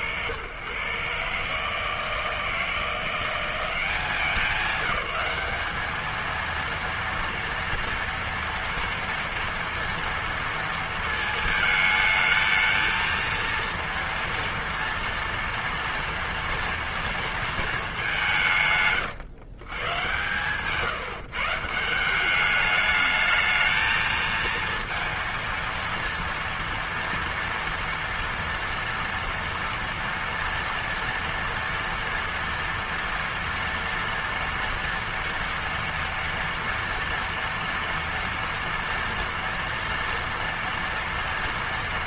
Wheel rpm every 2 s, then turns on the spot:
130, 160, 180, 230, 230, 230, 220, 230, 230, 160, 130, 210, 230, 230, 230, 230, 230, 230, 230, 230, 230.
none